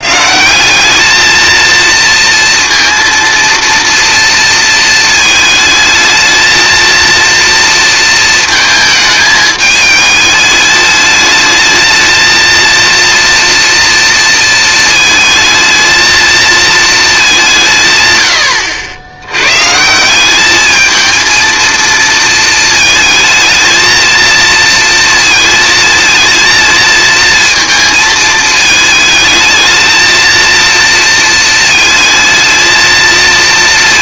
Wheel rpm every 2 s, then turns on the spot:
210, 230, 230, 230, 220, 210, 230, 230, 220, 80, 220, 220, 230, 230, 220, 230, 220.
none